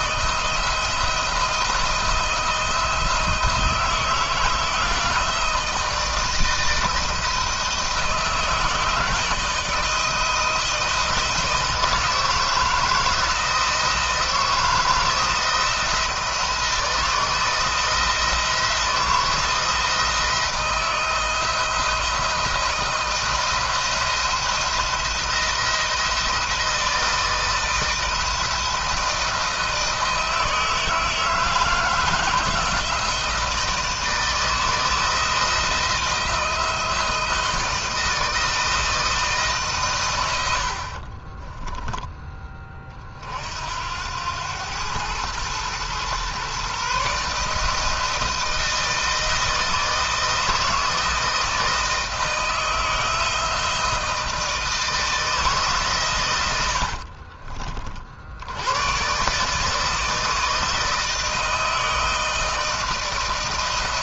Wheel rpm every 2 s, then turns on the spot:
170, 170, 160, 160, 160, 160, 160, 170, 170, 170, 160, 170, 170, 170, 170, 160, 160, 160, 170, 160, 80, 20, 100, 130, 160, 160, 160, 160, 90, 90, 160, 160.
56-58